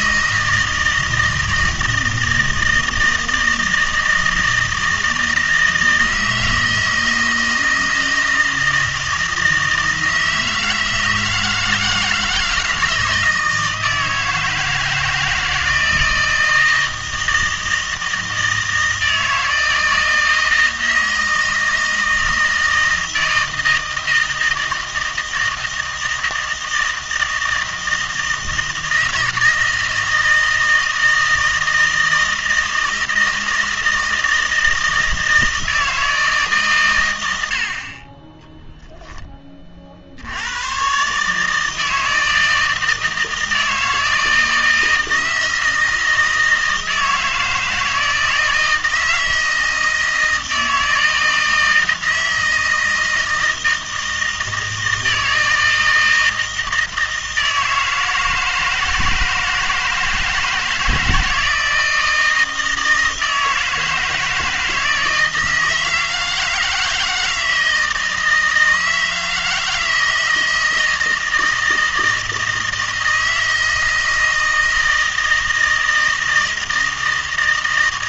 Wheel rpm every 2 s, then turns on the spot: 160, 160, 160, 160, 160, 160, 160, 160, 160, 160, 160, 160, 160, 160, 160, 160, 160, 160, 140, 10, 100, 160, 160, 160, 160, 160, 160, 160, 160, 160, 160, 160, 160, 160, 160, 160, 160, 160, 160.
none